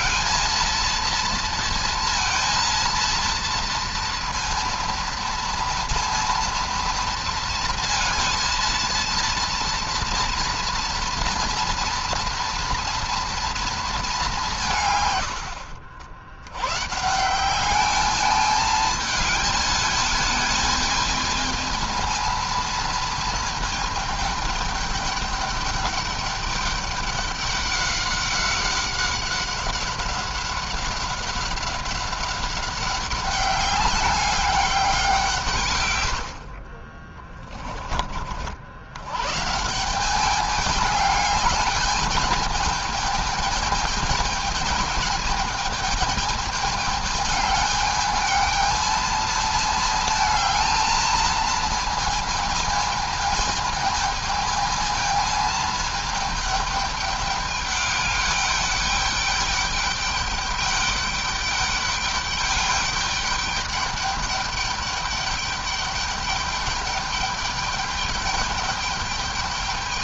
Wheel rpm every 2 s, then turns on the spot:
230, 230, 230, 230, 230, 230, 230, 160, 120, 210, 220, 230, 210, 200, 190, 190, 200, 200, 40, 90, 210, 220, 220, 210, 220, 220, 220, 220, 210, 210, 200, 200, 200, 200, 210.
36-38